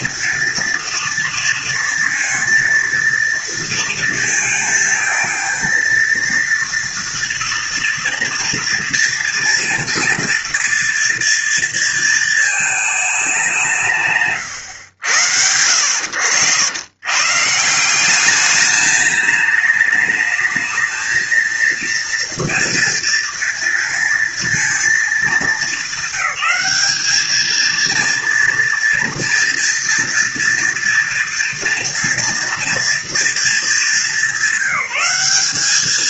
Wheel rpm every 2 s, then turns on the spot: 230, 230, 230, 230, 230, 230, 220, 100, 110, 210, 220, 230, 220, 200, 230, 230, 240, 200.
none